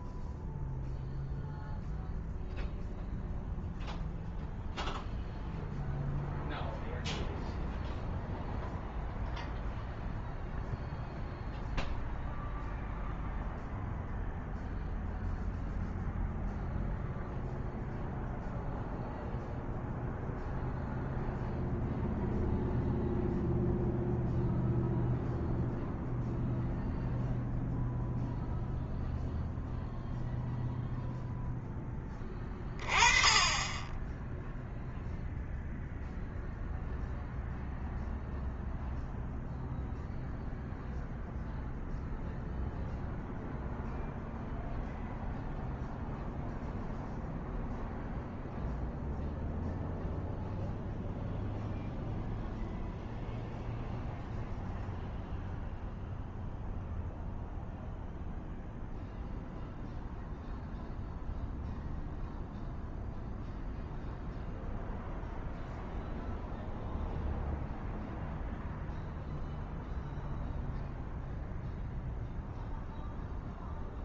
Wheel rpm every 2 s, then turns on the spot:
0, 0, 0, 0, 0, 0, 0, 0, 0, 0, 0, 0, 0, 0, 0, 0, 20, 0, 0, 0, 0, 0, 0, 0, 0, 0, 0, 0, 0, 0, 0, 0, 0, 0, 0, 0, 0.
none